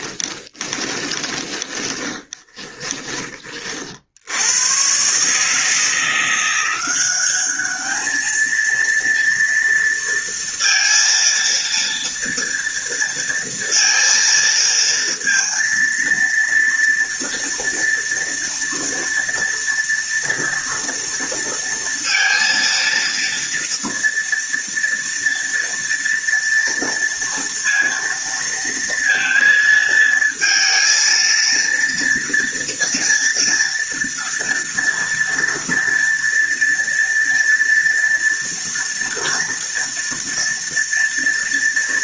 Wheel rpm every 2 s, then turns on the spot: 20, 20, 80, 170, 220, 230, 230, 230, 230, 230, 230, 230, 230, 230, 230, 230, 230, 230, 230, 230, 230.
0-4